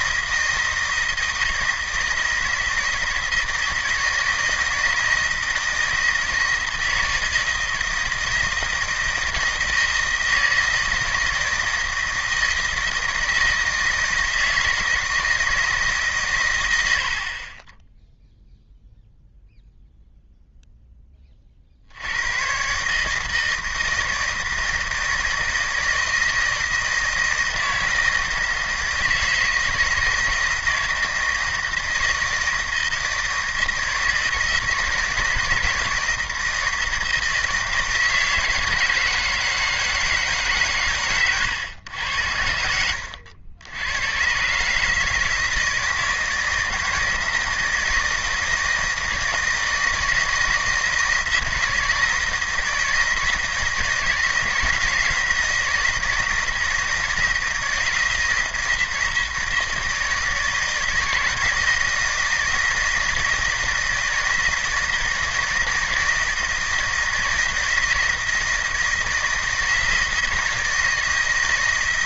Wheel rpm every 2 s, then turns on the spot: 160, 160, 160, 160, 160, 160, 160, 160, 90, 0, 0, 130, 160, 160, 160, 160, 160, 160, 170, 160, 140, 80, 140, 160, 160, 160, 160, 160, 160, 160, 160, 160, 160, 160, 160, 160.
none